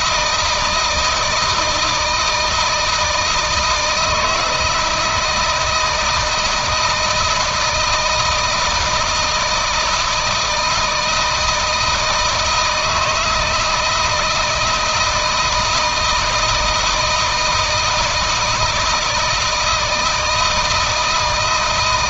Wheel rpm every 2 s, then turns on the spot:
170, 160, 160, 160, 160, 160, 160, 160, 160, 160, 160.
none